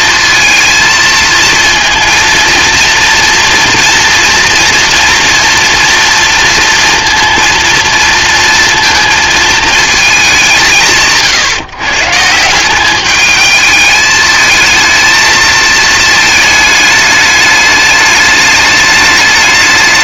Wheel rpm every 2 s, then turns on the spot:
230, 230, 230, 230, 230, 180, 180, 220, 210, 210.
none